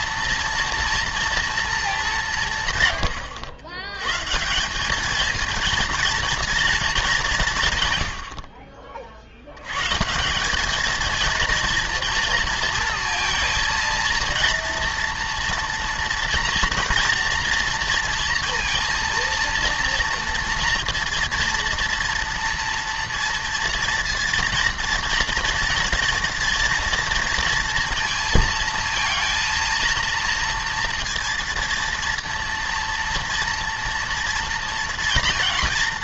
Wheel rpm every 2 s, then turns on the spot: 230, 140, 180, 230, 50, 210, 230, 230, 230, 230, 230, 230, 230, 230, 230, 230, 230, 230.
none